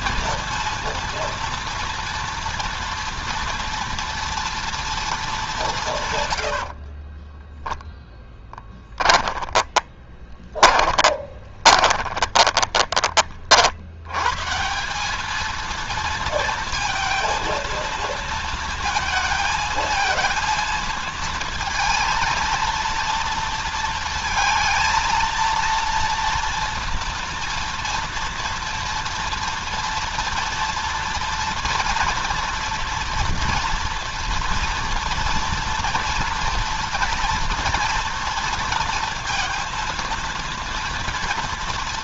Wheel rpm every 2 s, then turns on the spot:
230, 230, 230, 30, 10, 30, 20, 150, 230, 230, 230, 230, 230, 230, 230, 230, 230, 230, 230, 230, 230.
6-14